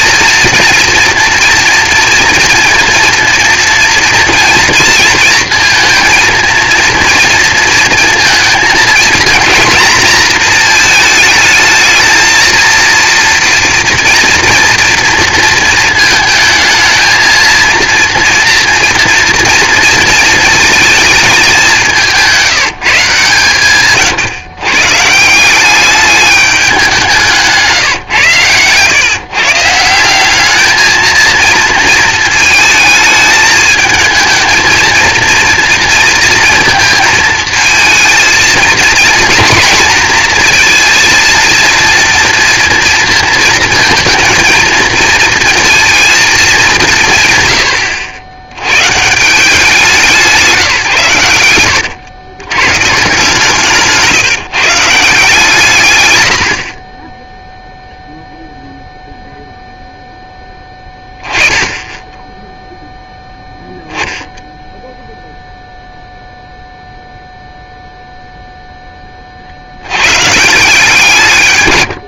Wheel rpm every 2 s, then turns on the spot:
230, 230, 230, 230, 220, 230, 230, 240, 220, 230, 220, 170, 130, 200, 120, 220, 220, 230, 230, 220, 230, 230, 230, 200, 120, 150, 130, 160, 60, 0, 10, 0, 0, 0, 0, 160.
none